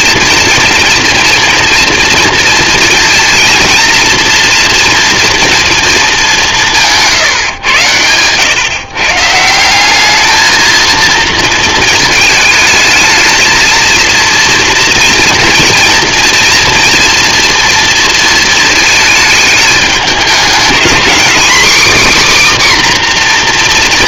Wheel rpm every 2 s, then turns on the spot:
230, 230, 240, 190, 120, 220, 220, 240, 240, 220, 220, 280.
none